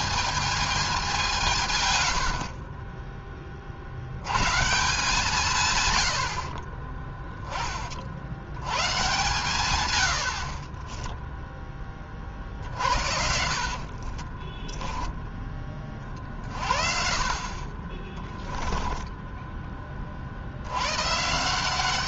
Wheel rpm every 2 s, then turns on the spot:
210, 50, 130, 50, 80, 50, 40, 20, 50, 10, 90.
6-8 10-16 18-20